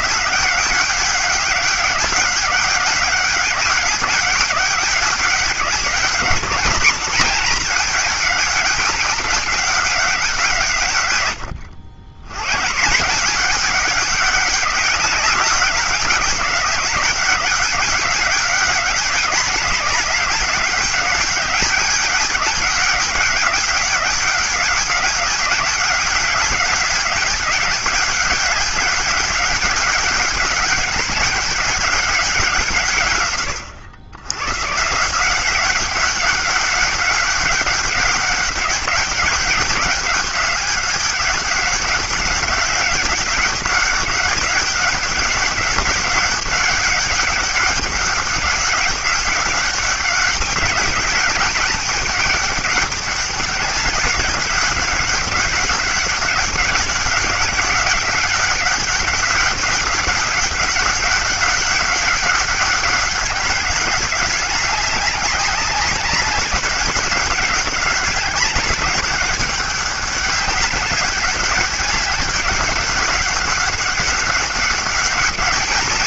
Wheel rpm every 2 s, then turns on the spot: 200, 200, 200, 220, 200, 150, 150, 190, 190, 200, 200, 200, 200, 200, 200, 200, 150, 140, 200, 200, 200, 200, 200, 190, 200, 200, 200, 200, 190, 200, 200, 200, 200, 200, 200, 200, 200, 200.
none